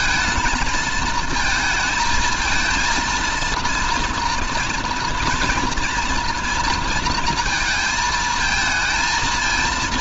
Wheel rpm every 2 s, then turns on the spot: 220, 230, 240, 230, 230.
none